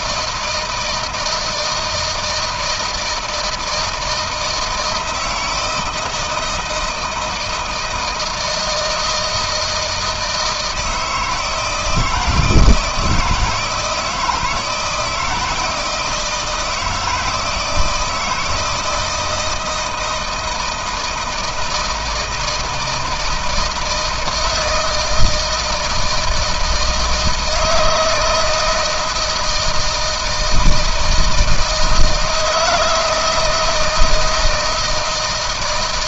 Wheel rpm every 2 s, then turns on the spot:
170, 160, 160, 160, 160, 160, 160, 160, 160, 160, 160, 160, 160, 160, 160, 160, 160, 160.
none